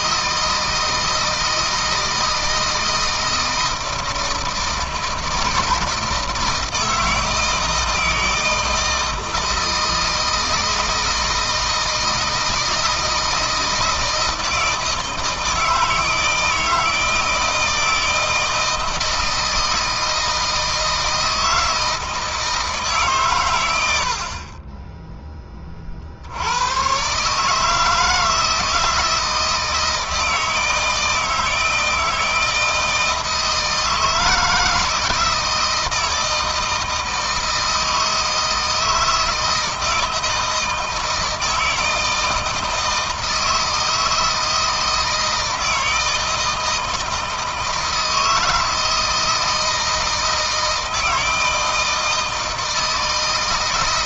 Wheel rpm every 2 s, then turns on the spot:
160, 160, 160, 160, 160, 160, 160, 160, 160, 160, 160, 150, 20, 120, 160, 160, 160, 160, 160, 160, 160, 160, 160, 160, 160, 160, 160.
none